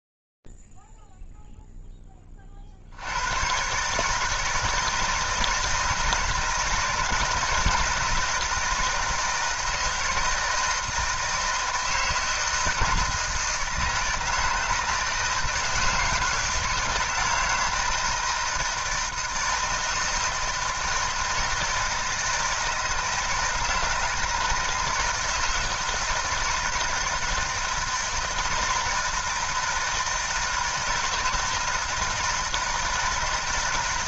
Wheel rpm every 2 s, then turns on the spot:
0, 0, 140, 160, 160, 160, 160, 160, 160, 160, 160, 160, 160, 160, 160, 160, 160.
none